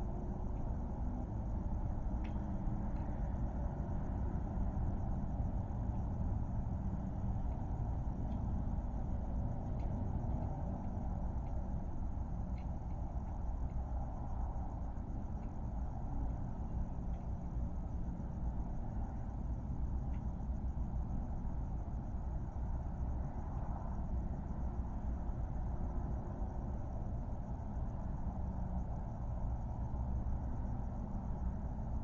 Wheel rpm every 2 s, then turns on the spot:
0, 0, 0, 0, 0, 0, 0, 0, 0, 0, 0, 0, 0, 0, 0, 0.
none